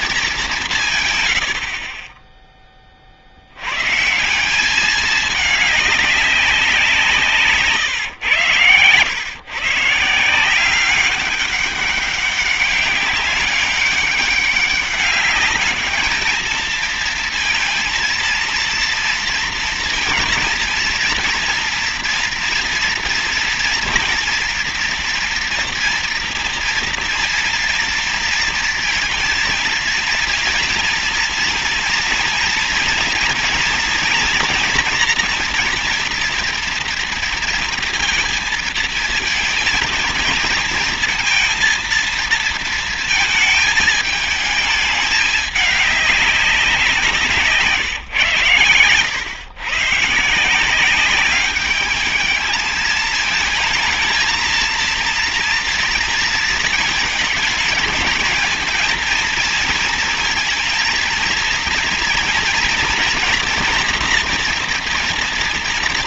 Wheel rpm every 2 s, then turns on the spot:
180, 20, 190, 180, 110, 170, 190, 200, 220, 230, 230, 230, 240, 230, 230, 230, 230, 240, 230, 230, 230, 230, 220, 190, 120, 170, 220, 220, 230, 220, 230, 230, 240.
none